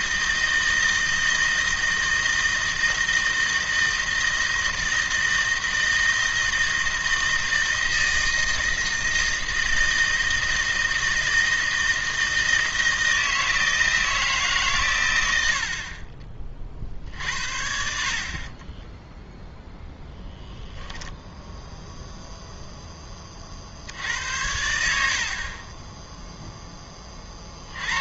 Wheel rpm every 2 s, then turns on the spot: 160, 160, 160, 160, 160, 160, 160, 130, 60, 20, 0, 0, 90, 10.
18-20